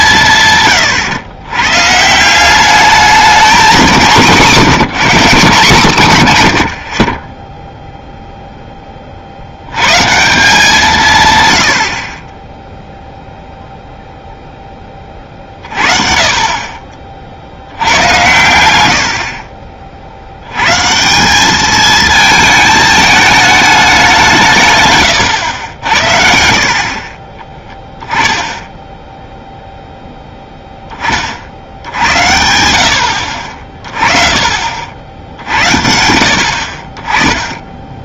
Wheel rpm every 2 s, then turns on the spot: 120, 200, 170, 30, 0, 170, 10, 20, 40, 90, 100, 220, 170, 60, 10, 10, 80, 40, 50.
none